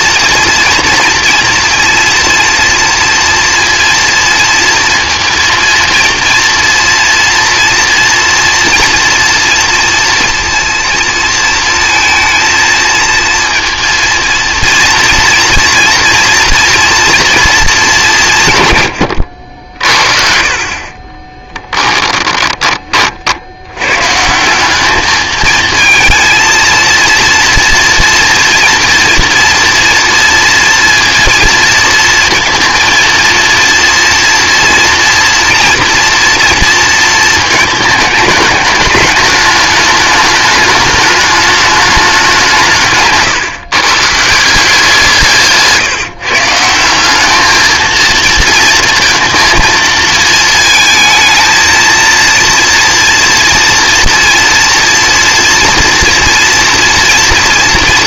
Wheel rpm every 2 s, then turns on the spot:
230, 230, 230, 230, 230, 230, 230, 230, 230, 130, 40, 20, 200, 230, 240, 230, 230, 240, 230, 210, 210, 170, 170, 170, 230, 220, 230, 240, 230.
none